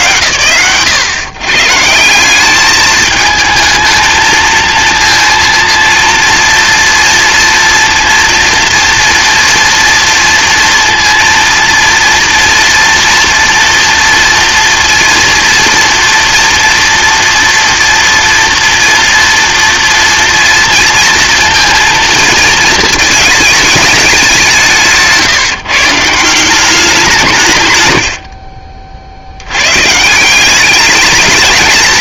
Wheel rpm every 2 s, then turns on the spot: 110, 210, 230, 230, 230, 230, 230, 240, 240, 230, 230, 230, 170, 180, 40, 190.
28-30